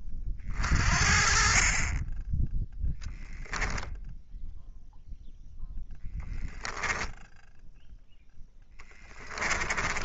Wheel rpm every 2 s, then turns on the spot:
20, 10, 0, 20, 10.
none